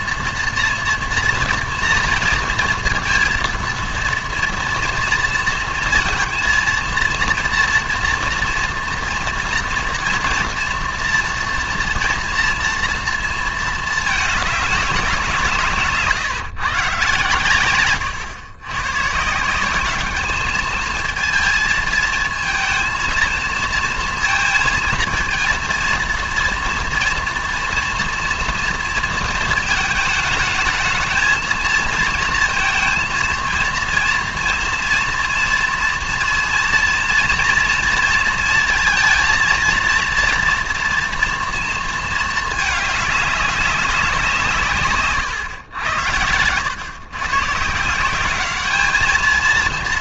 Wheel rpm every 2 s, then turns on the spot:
230, 230, 230, 230, 230, 230, 230, 210, 140, 120, 220, 220, 230, 230, 230, 220, 230, 230, 230, 230, 230, 210, 150, 100, 210.
none